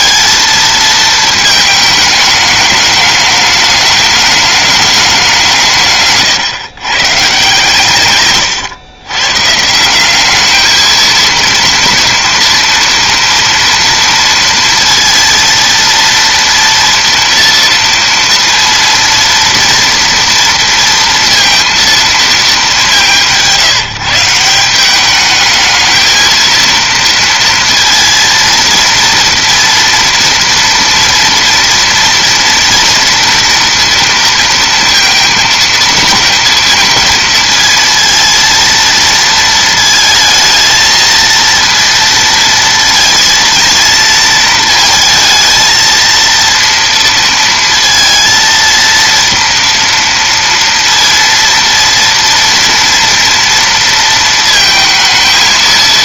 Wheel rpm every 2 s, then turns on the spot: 230, 210, 210, 120, 130, 220, 230, 230, 230, 230, 230, 200, 180, 230, 230, 240, 230, 230, 230, 230, 230, 230, 220, 230, 230, 230, 230, 220.
none